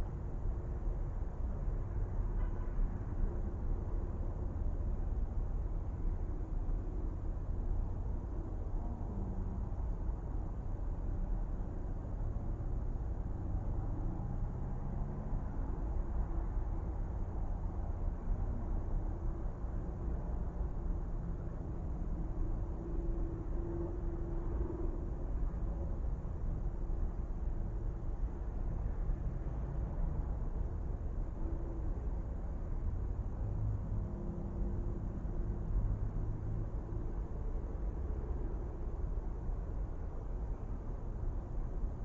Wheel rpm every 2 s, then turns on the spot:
0, 0, 0, 0, 0, 0, 0, 0, 0, 0, 0, 0, 0, 0, 0, 0, 0, 0, 0, 0, 0.
none